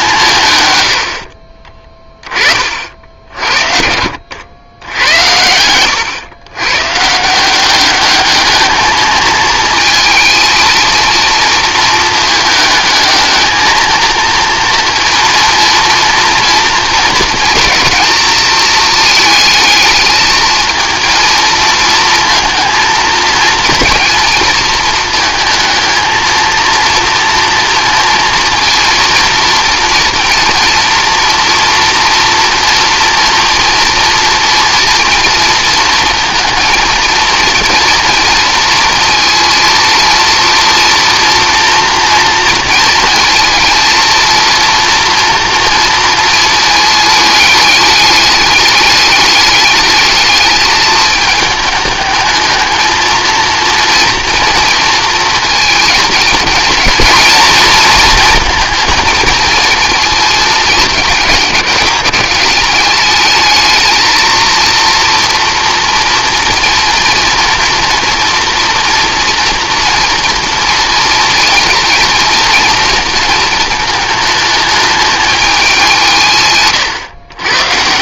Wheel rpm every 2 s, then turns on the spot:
100, 50, 100, 130, 220, 230, 210, 230, 230, 220, 230, 230, 230, 230, 230, 230, 230, 230, 230, 230, 240, 230, 230, 220, 210, 210, 220, 230, 230, 230, 210, 200, 230, 230, 240, 240, 230, 210, 130.
none